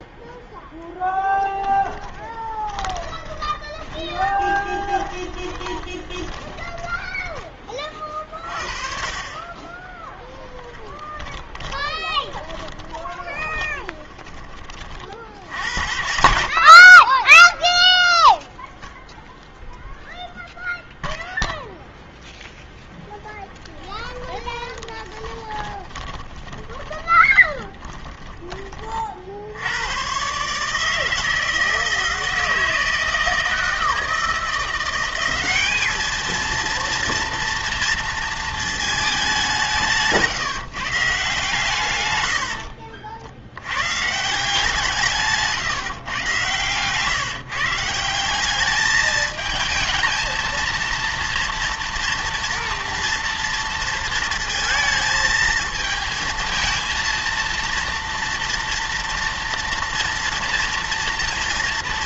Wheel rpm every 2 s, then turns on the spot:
0, 20, 20, 20, 40, 10, 10, 30, 50, 0, 0, 10, 10, 20, 20, 150, 160, 170, 230, 220, 150, 60, 170, 130, 200, 230, 230, 230, 230, 240, 230.
2-8 10-14 24-28 42-44